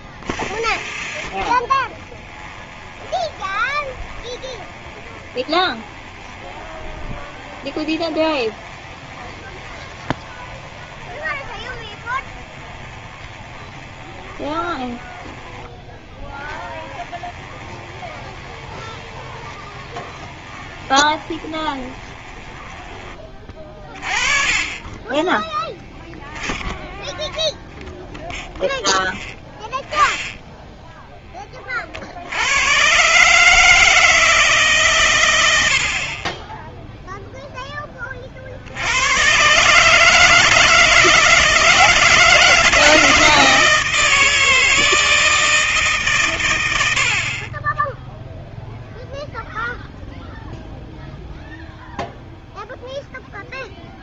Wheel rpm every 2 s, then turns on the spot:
30, 20, 20, 20, 20, 20, 20, 10, 10, 20, 20, 20, 30, 10, 0, 10, 100, 140, 20, 40, 160, 160, 160, 100, 0, 0, 0.
0-26